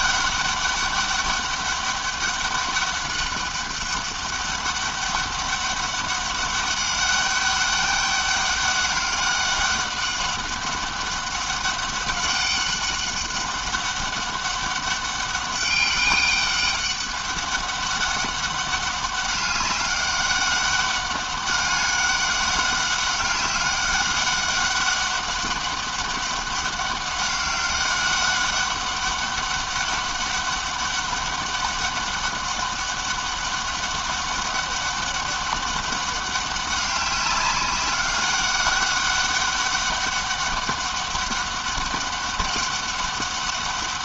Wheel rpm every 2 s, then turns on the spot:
200, 200, 200, 200, 200, 200, 200, 200, 200, 190, 200, 200, 200, 200, 200, 200, 200, 200, 200, 200, 190, 200.
none